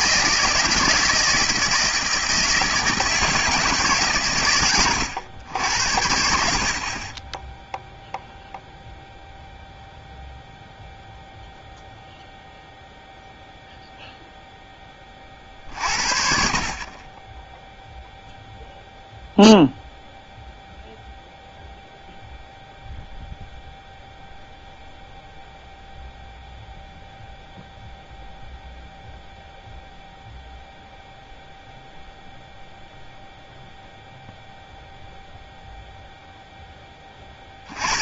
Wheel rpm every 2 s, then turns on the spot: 160, 160, 120, 60, 0, 0, 0, 0, 40, 0, 0, 0, 0, 0, 0, 0, 0, 0, 0.
none